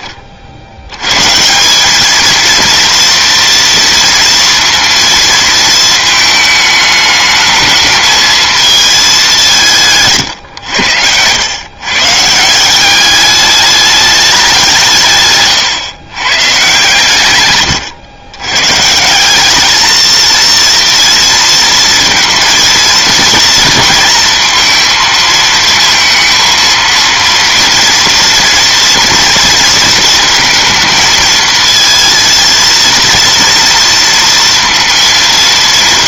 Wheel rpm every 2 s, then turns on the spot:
30, 220, 230, 220, 220, 140, 160, 190, 130, 120, 230, 230, 230, 230, 230, 230, 230, 230.
none